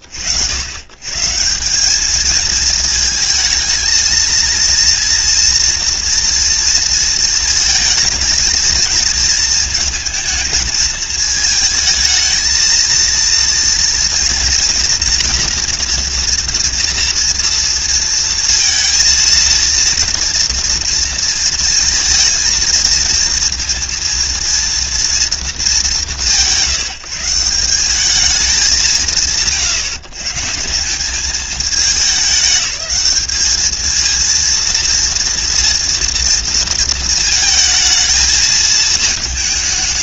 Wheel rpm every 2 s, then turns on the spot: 100, 220, 230, 220, 230, 220, 230, 240, 230, 230, 230, 230, 230, 160, 130, 190, 210, 230, 220, 220.
none